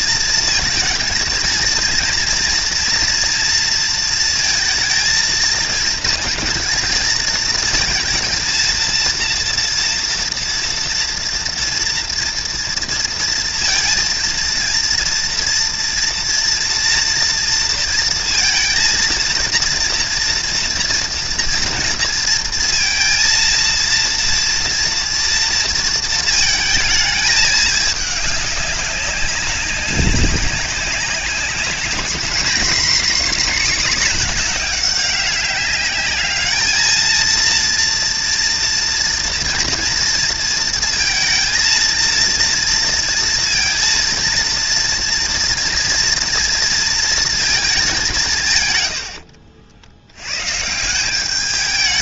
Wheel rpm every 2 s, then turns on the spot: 230, 230, 230, 230, 230, 230, 230, 230, 240, 230, 230, 230, 230, 220, 200, 190, 260, 210, 220, 230, 220, 230, 240, 230, 100, 180.
none